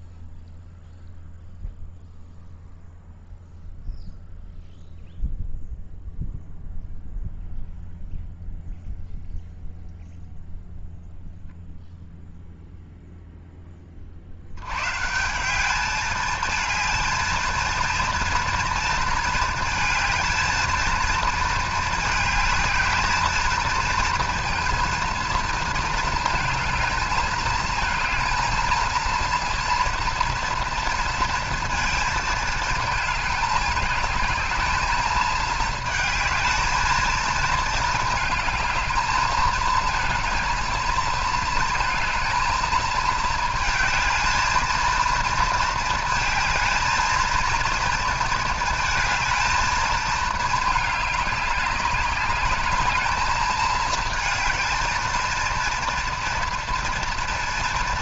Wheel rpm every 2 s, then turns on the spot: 0, 0, 0, 0, 0, 0, 0, 90, 220, 230, 220, 210, 230, 230, 220, 230, 220, 220, 220, 220, 230, 220, 220, 220, 220, 220, 200, 220, 230.
none